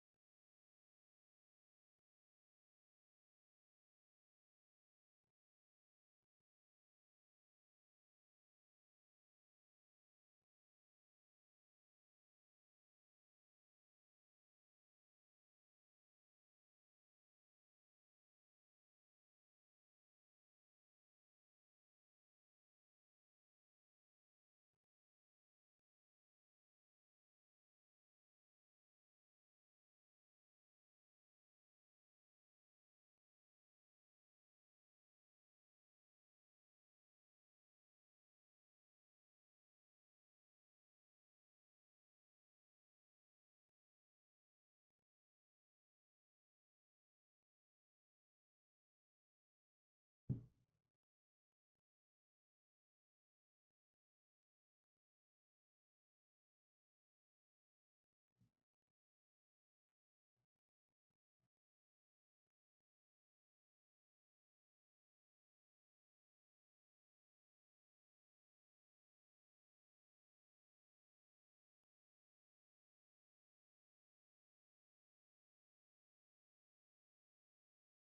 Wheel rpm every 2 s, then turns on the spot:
0, 0, 0, 0, 0, 0, 0, 0, 0, 0, 0, 0, 0, 0, 0, 0, 0, 0, 0, 0, 0, 0, 0, 0, 0, 0, 0, 0, 0, 0, 0, 0, 0, 0, 0, 0, 0, 0, 0.
none